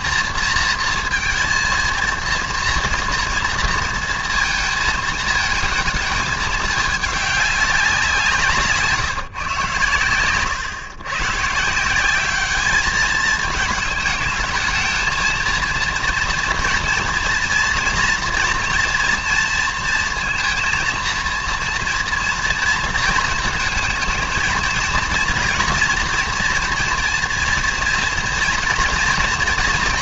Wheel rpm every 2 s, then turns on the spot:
230, 230, 230, 210, 150, 110, 210, 220, 230, 230, 230, 230, 230, 240, 230.
none